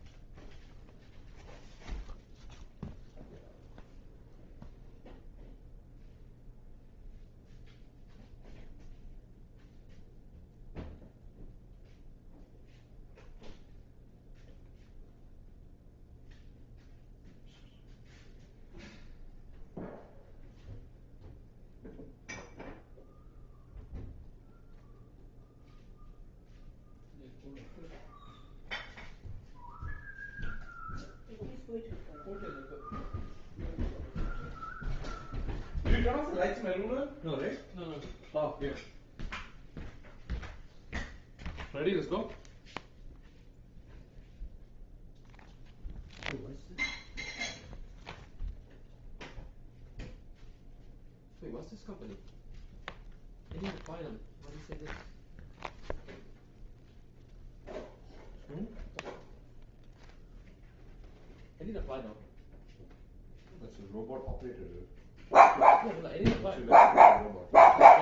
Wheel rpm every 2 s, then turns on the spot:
0, 0, 0, 0, 0, 0, 0, 0, 0, 0, 0, 0, 0, 0, 0, 0, 0, 0, 0, 0, 0, 0, 0, 0, 0, 0, 0, 0, 0, 0, 0, 0, 0, 0.
none